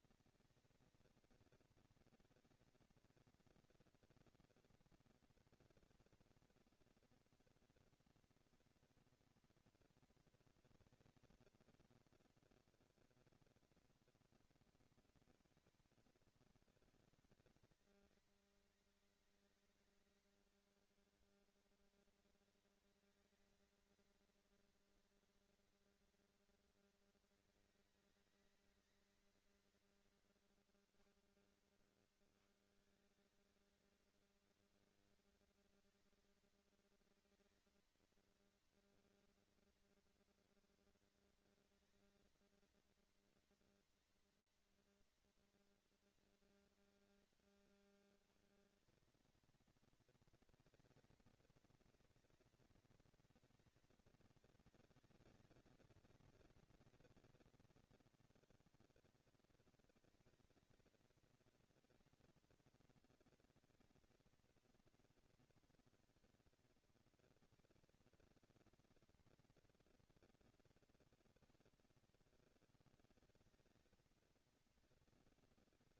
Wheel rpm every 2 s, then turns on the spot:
220, 230, 230, 230, 240, 230, 230, 230, 210, 200, 210, 230, 240, 230, 220, 170, 160, 230, 230, 230, 230, 230, 230, 210, 200, 220, 220, 200, 200, 210, 220, 230, 230, 220, 230, 180, 210, 230.
none